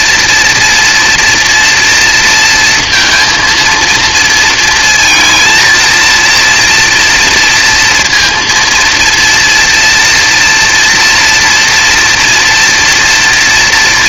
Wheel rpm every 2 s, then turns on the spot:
240, 230, 230, 230, 230, 230, 240.
none